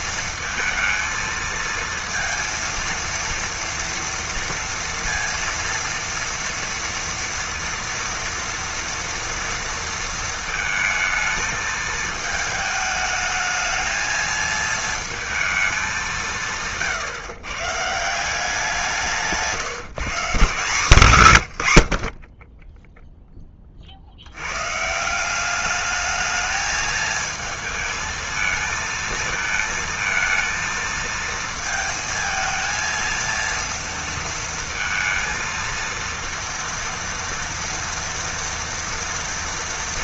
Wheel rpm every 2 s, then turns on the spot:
230, 230, 230, 230, 230, 230, 220, 220, 170, 180, 160, 20, 130, 220, 220, 220, 230, 230, 230, 230.
none